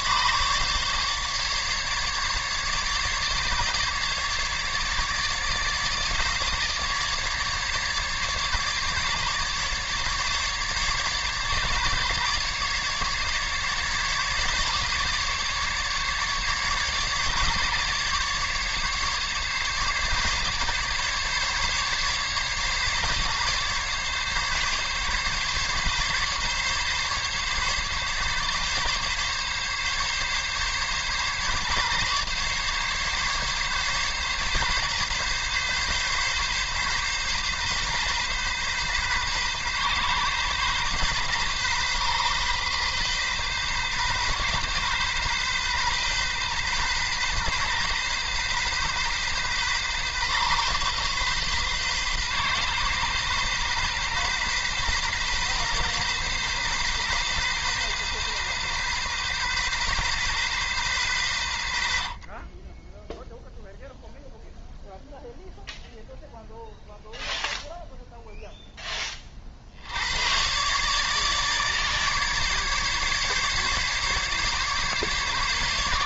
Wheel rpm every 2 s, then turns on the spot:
140, 140, 150, 150, 140, 140, 140, 150, 150, 140, 140, 140, 140, 140, 140, 140, 140, 140, 140, 130, 130, 130, 130, 130, 130, 130, 130, 130, 130, 130, 120, 10, 0, 0, 20, 140, 140, 140.
none